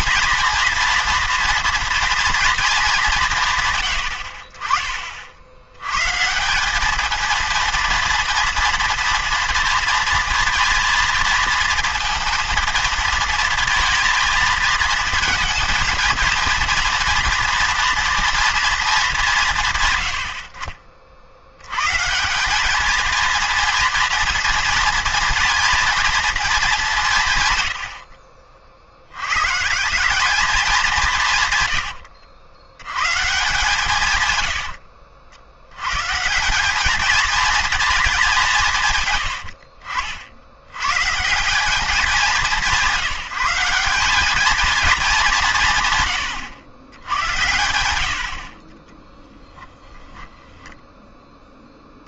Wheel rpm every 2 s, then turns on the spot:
230, 220, 40, 190, 230, 230, 230, 230, 230, 230, 60, 200, 230, 210, 60, 190, 70, 90, 190, 160, 90, 190, 220, 110, 40, 0.
none